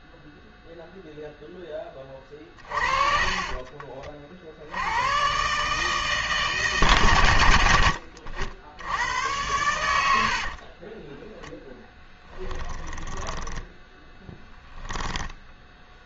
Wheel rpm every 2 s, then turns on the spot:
0, 20, 80, 100, 100, 20, 20, 10.
2-4 10-16